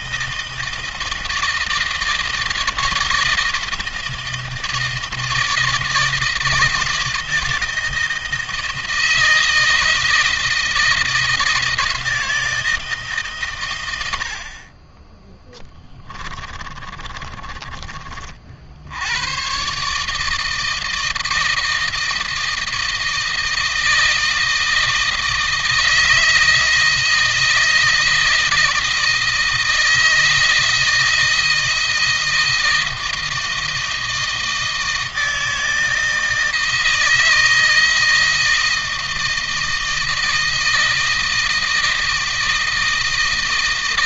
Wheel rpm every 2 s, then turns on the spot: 160, 160, 160, 160, 160, 160, 160, 40, 30, 70, 160, 160, 160, 160, 160, 160, 160, 160, 160, 160, 160, 160.
16-18